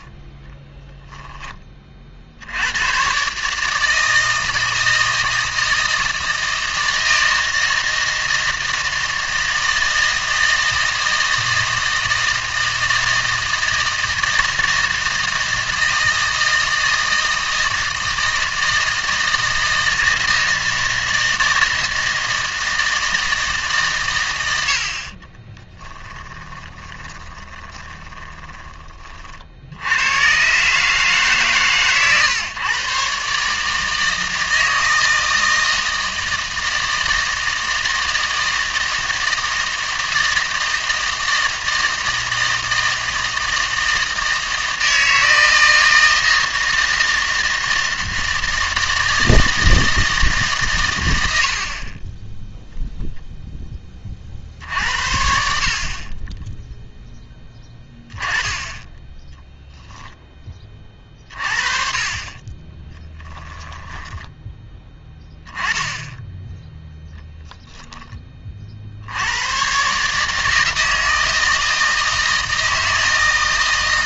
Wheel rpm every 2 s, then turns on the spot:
10, 100, 160, 160, 160, 160, 160, 160, 160, 160, 160, 160, 80, 10, 20, 140, 120, 160, 160, 160, 160, 160, 160, 160, 160, 140, 0, 60, 10, 20, 20, 20, 10, 0, 50, 160, 160.
0-2 26-28